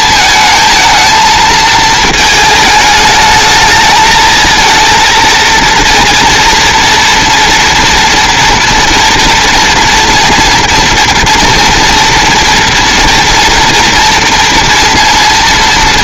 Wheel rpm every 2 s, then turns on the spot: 220, 220, 230, 230, 230, 230, 230, 230.
none